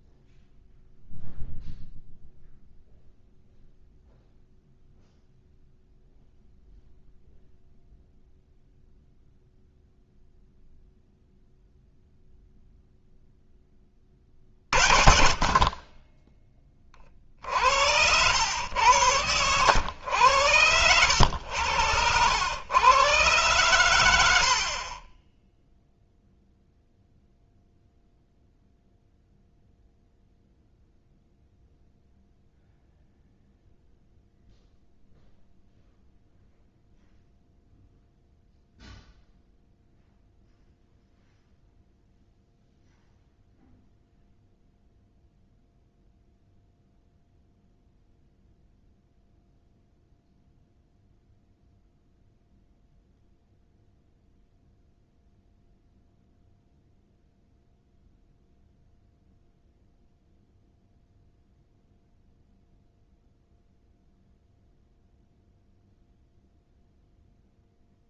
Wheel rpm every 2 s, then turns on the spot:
0, 0, 0, 0, 0, 0, 0, 40, 20, 90, 90, 90, 70, 0, 0, 0, 0, 0, 0, 0, 0, 0, 0, 0, 0, 0, 0, 0, 0, 0, 0, 0, 0, 0.
none